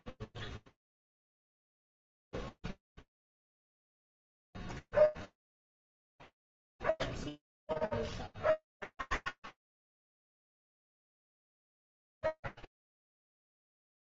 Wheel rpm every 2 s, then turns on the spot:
0, 0, 0, 0, 30, 0, 0.
none